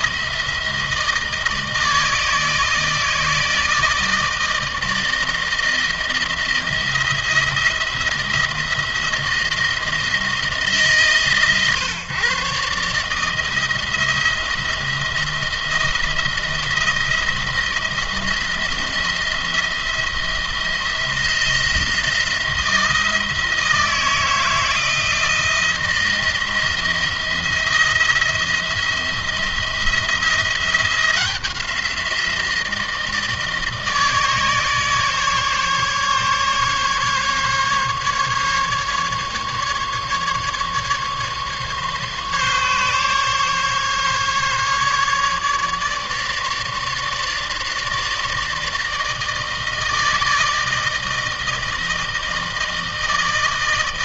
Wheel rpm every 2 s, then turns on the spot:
160, 160, 160, 170, 160, 150, 140, 170, 170, 170, 170, 160, 160, 170, 160, 170, 170, 150, 150, 140, 150, 140, 150, 150, 160, 160, 160.
none